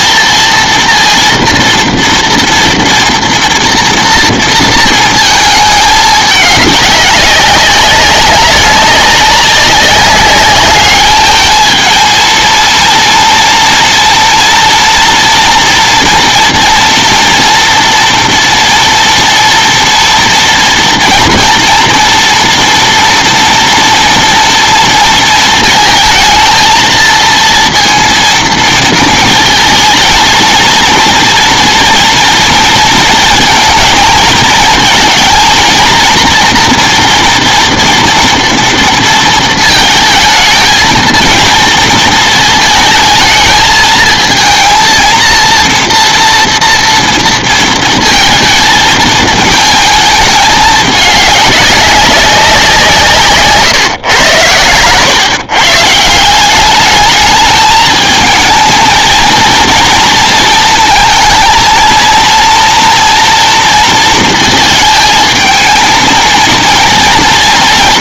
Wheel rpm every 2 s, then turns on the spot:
230, 230, 230, 210, 190, 200, 230, 230, 240, 240, 230, 230, 230, 220, 230, 230, 230, 230, 230, 230, 220, 220, 230, 230, 220, 210, 170, 110, 200, 230, 230, 230, 220, 230.
none